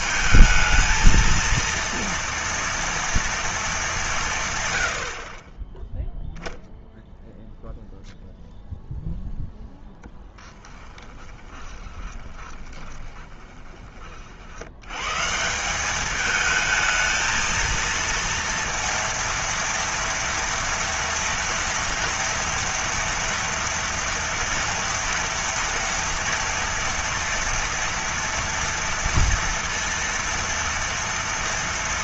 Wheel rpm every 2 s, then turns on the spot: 220, 240, 90, 0, 0, 10, 20, 110, 220, 230, 230, 230, 230, 230, 230, 230.
10-14